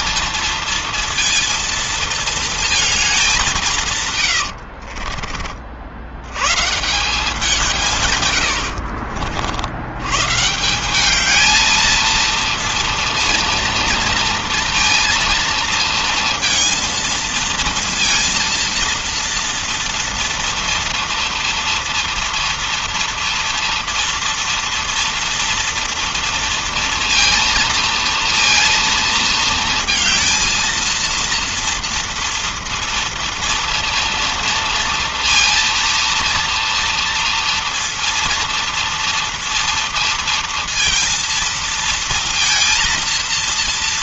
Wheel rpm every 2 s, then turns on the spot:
230, 210, 40, 170, 70, 210, 230, 230, 230, 230, 240, 240, 230, 230, 220, 230, 230, 230, 230, 230, 230, 230.
4-6